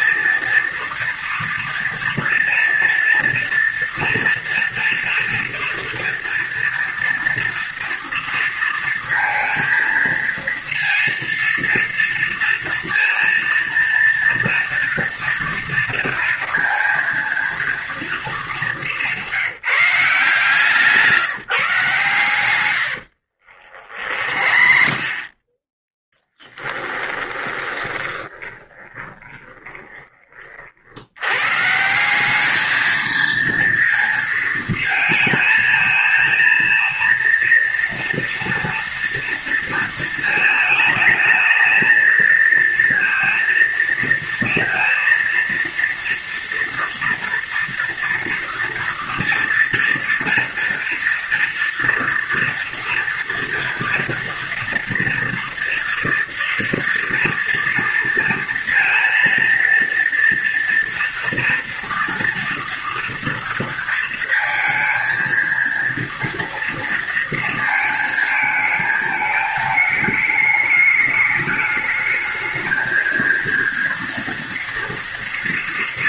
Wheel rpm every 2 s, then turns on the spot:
230, 230, 230, 230, 230, 230, 230, 230, 230, 200, 160, 100, 30, 10, 20, 50, 210, 220, 230, 230, 220, 230, 230, 230, 230, 230, 230, 230, 230, 230, 230, 230, 230, 230, 220, 210, 220, 230.
22-30